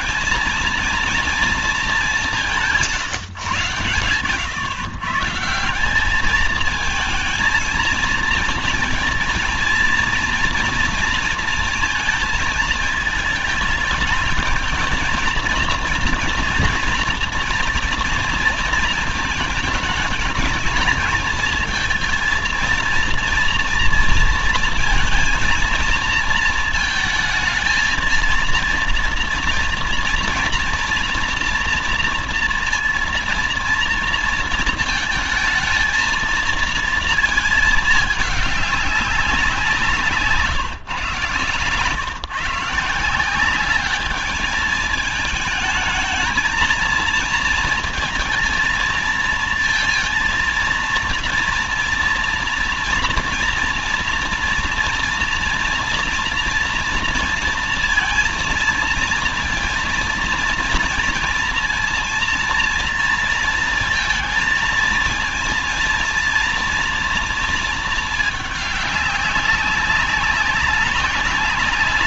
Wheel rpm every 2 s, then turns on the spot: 230, 170, 120, 220, 230, 240, 220, 220, 230, 230, 210, 230, 230, 220, 230, 240, 230, 230, 230, 200, 150, 160, 210, 220, 220, 230, 230, 230, 230, 230, 230, 230, 230, 230, 210, 200.
none